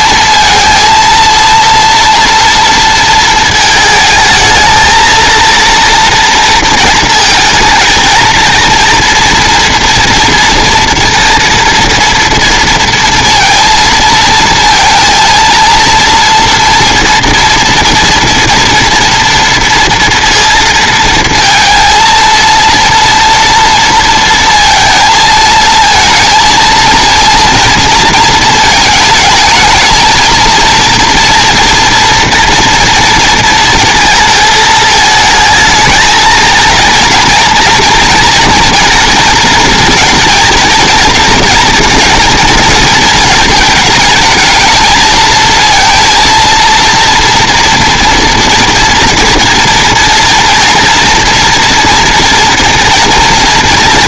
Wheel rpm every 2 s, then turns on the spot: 230, 230, 220, 230, 230, 230, 230, 230, 230, 230, 230, 230, 230, 230, 220, 230, 240, 220, 230, 230, 230, 230, 220, 230, 230, 240, 230.
none